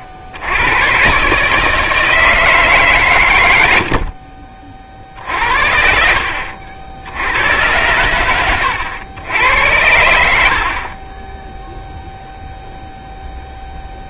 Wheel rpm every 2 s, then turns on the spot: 70, 150, 40, 60, 100, 60, 0.
none